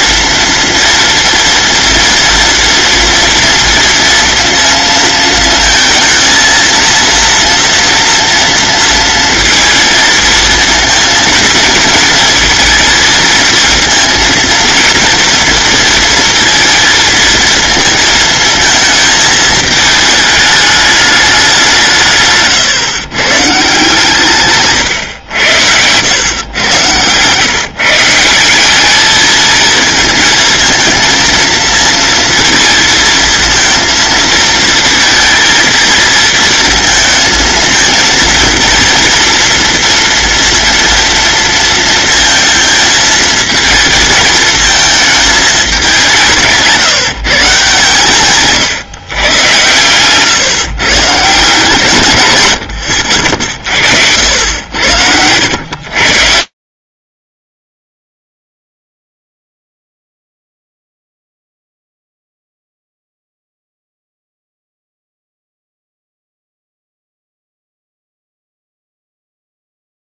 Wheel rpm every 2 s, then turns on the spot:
230, 230, 230, 230, 230, 230, 230, 230, 230, 220, 210, 130, 140, 110, 200, 220, 230, 230, 220, 230, 230, 230, 220, 150, 150, 140, 90, 80, 50, 0, 0, 0, 0, 0, 0.
none